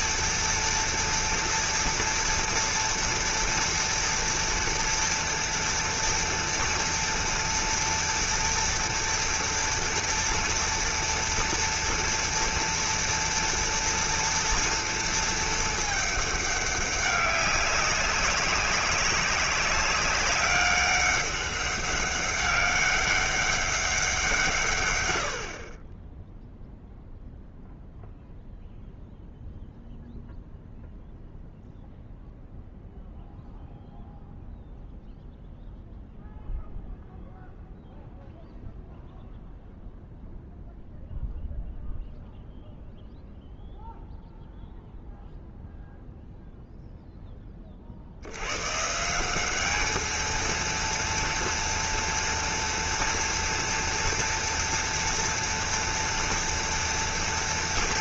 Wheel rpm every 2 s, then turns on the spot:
240, 230, 230, 240, 240, 230, 230, 230, 200, 190, 200, 200, 140, 0, 0, 0, 0, 0, 0, 0, 0, 0, 0, 0, 130, 230, 230, 230, 230.
none